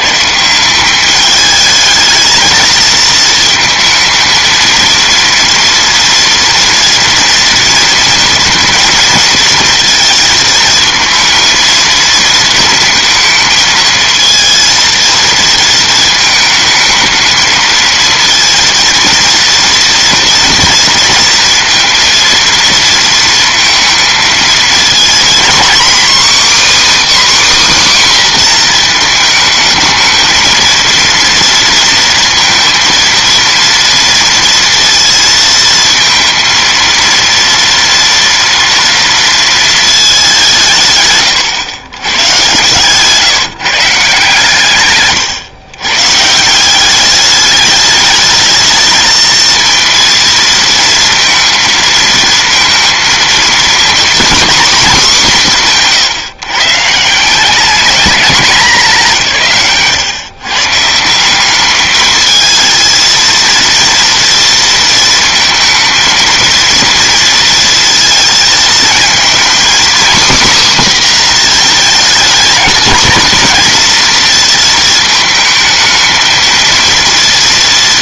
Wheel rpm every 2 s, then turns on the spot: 190, 220, 230, 230, 230, 230, 220, 230, 220, 230, 230, 230, 230, 300, 240, 230, 230, 230, 230, 230, 140, 130, 130, 190, 220, 230, 230, 240, 150, 190, 150, 220, 230, 230, 220, 260, 230, 220, 230.
none